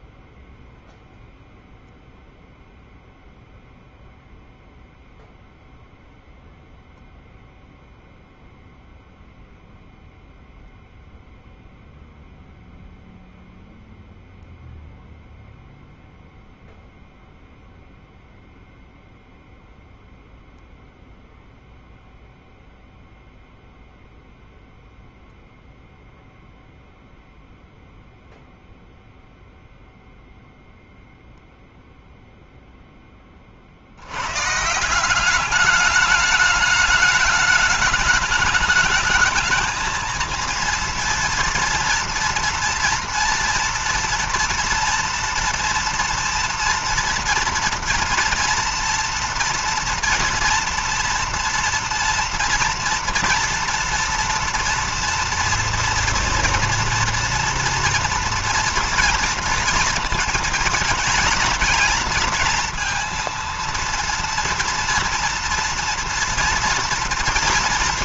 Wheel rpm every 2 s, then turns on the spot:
0, 0, 0, 0, 0, 0, 0, 0, 0, 0, 0, 0, 0, 0, 0, 0, 10, 170, 210, 220, 230, 230, 230, 230, 230, 230, 230, 230, 240, 230, 230, 230, 230, 230.
none